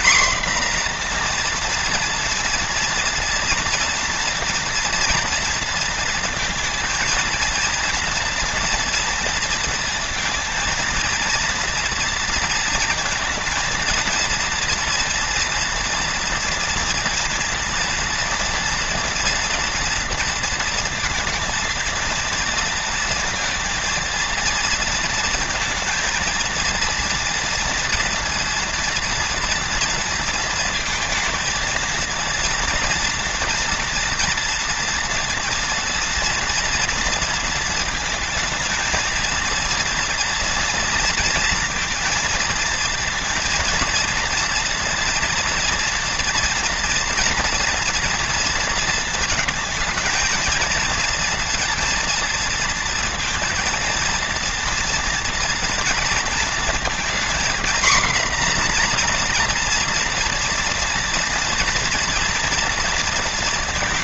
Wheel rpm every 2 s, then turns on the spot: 240, 230, 230, 230, 230, 230, 230, 230, 230, 240, 230, 230, 230, 230, 230, 230, 240, 230, 230, 220, 230, 230, 230, 230, 230, 230, 230, 230, 230, 240, 230, 230.
none